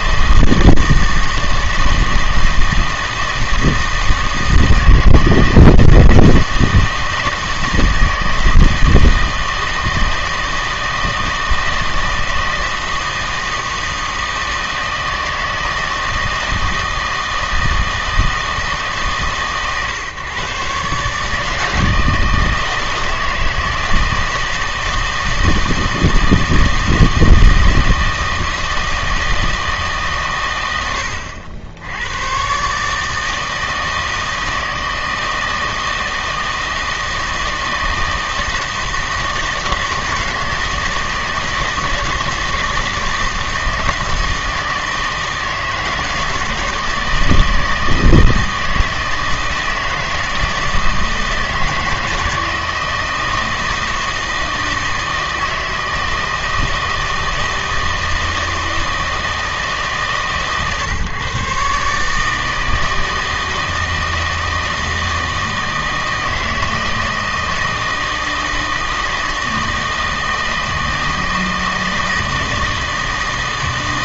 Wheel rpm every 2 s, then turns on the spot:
160, 160, 160, 160, 160, 160, 160, 160, 160, 150, 130, 160, 160, 160, 160, 100, 140, 160, 160, 160, 160, 160, 160, 160, 160, 160, 160, 160, 160, 160, 140, 160, 160, 160, 160, 160, 160.
none